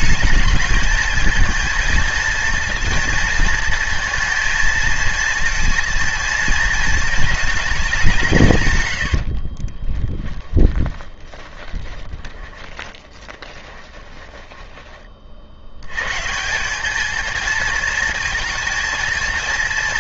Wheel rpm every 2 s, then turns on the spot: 220, 230, 230, 220, 120, 30, 20, 20, 200, 230.
8-14